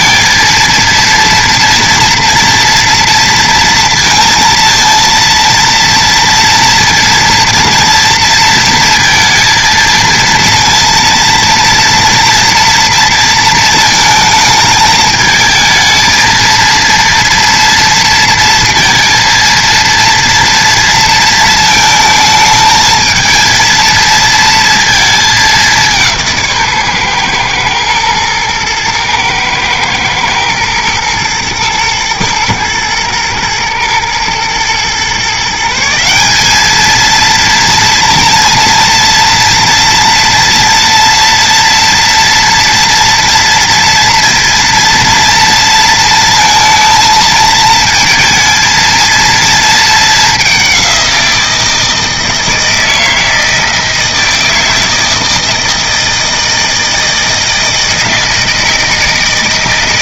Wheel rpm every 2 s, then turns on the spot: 230, 230, 230, 230, 230, 230, 230, 220, 230, 230, 230, 220, 230, 140, 110, 120, 110, 120, 210, 230, 230, 240, 230, 230, 220, 200, 160, 160, 160, 160.
none